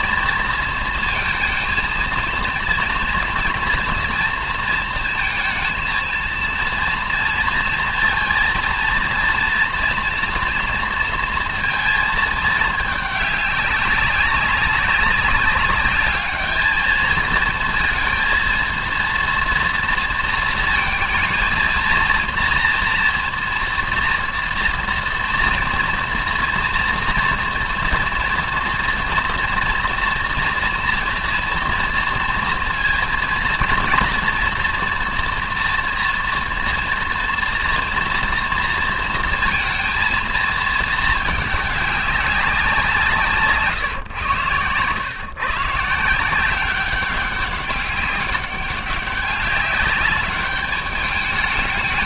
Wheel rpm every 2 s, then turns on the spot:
230, 230, 230, 230, 230, 230, 210, 200, 220, 230, 220, 230, 230, 230, 230, 230, 230, 230, 230, 230, 220, 180, 120, 190, 200, 210.
none